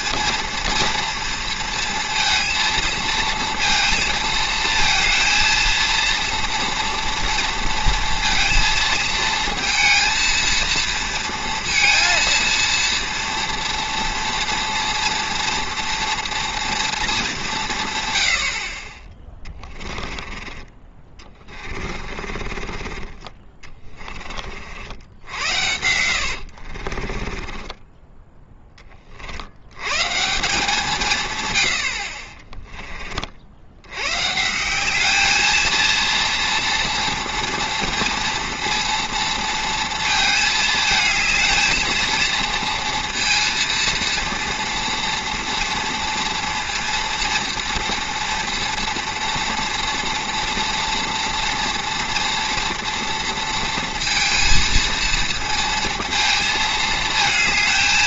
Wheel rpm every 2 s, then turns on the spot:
230, 230, 230, 230, 230, 230, 230, 230, 240, 50, 20, 30, 60, 60, 20, 170, 20, 180, 240, 230, 220, 230, 230, 230, 230, 230, 230, 230, 220.
22-24 26-28 32-34